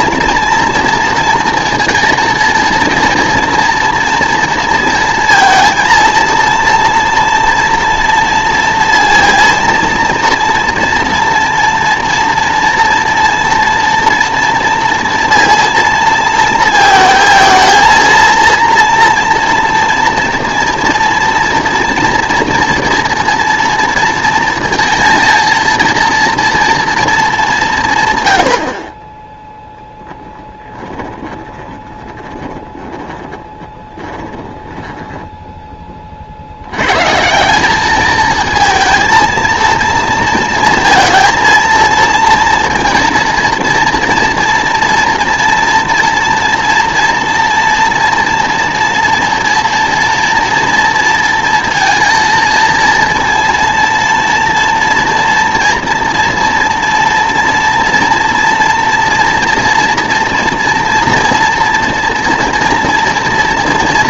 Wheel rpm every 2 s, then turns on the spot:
230, 230, 230, 230, 230, 230, 230, 230, 230, 230, 230, 230, 230, 230, 50, 10, 10, 10, 90, 220, 230, 230, 230, 230, 230, 240, 230, 230, 230, 230, 230, 230.
30-36